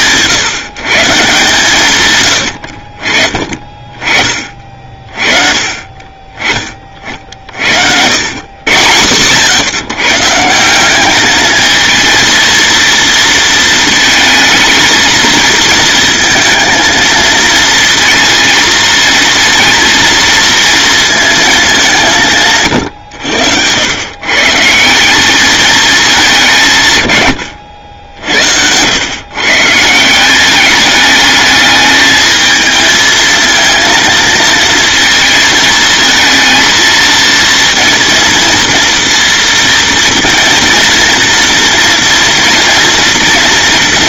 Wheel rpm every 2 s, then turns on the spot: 150, 50, 40, 30, 100, 190, 230, 220, 230, 230, 230, 120, 170, 140, 100, 210, 220, 220, 230, 230, 230, 240.
none